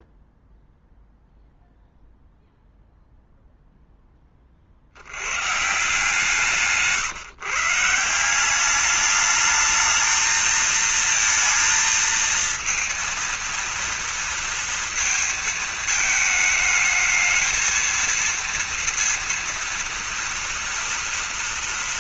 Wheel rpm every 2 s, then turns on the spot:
0, 0, 50, 150, 190, 220, 230, 230, 220, 230, 230.
none